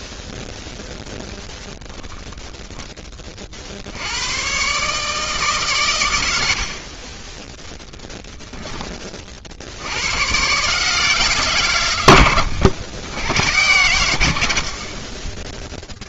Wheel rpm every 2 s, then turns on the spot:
0, 10, 140, 70, 30, 150, 90, 40.
6-10